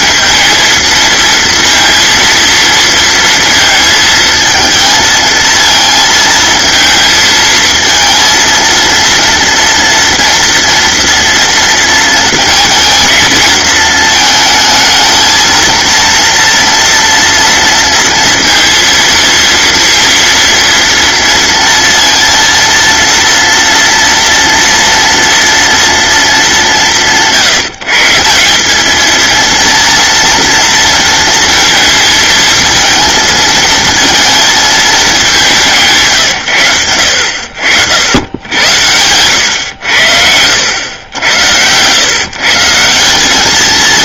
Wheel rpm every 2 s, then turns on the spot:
230, 230, 230, 230, 230, 230, 230, 220, 230, 230, 230, 230, 230, 230, 160, 230, 230, 220, 180, 80, 100, 100.
none